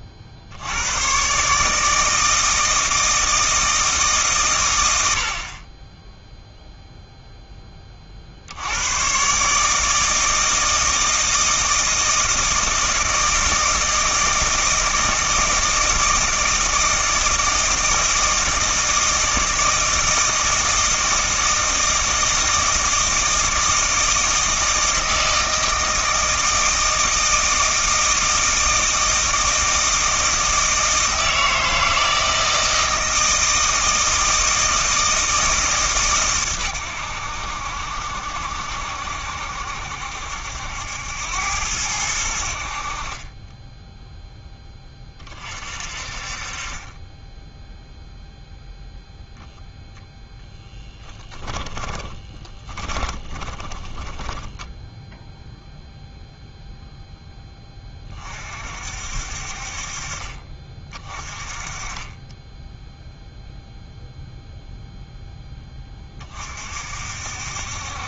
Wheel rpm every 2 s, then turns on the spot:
90, 160, 100, 0, 80, 160, 160, 160, 160, 160, 160, 160, 160, 160, 160, 160, 160, 160, 110, 70, 80, 60, 20, 20, 0, 10, 20, 10, 0, 50, 30, 10, 0, 50.
50-56